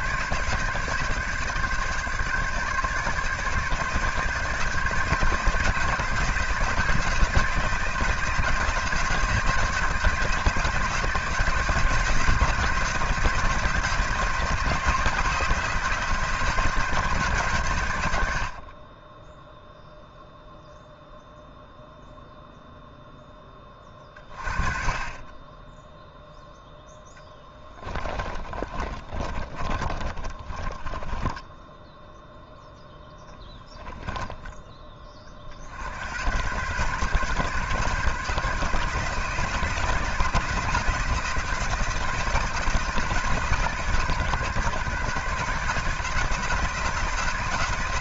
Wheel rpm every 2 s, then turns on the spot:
140, 140, 150, 170, 170, 170, 170, 170, 170, 40, 0, 0, 30, 0, 30, 20, 0, 20, 130, 160, 160, 160, 140, 170.
28-32